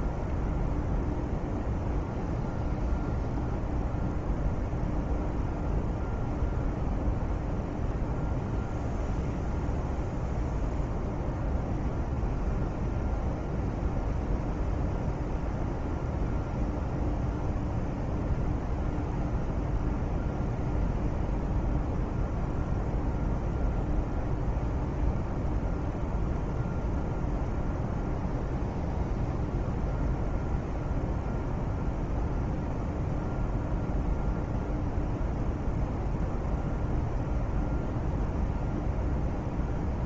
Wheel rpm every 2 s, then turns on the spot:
0, 0, 0, 0, 0, 0, 0, 0, 0, 0, 0, 0, 0, 0, 0, 0, 0, 0, 0, 0.
none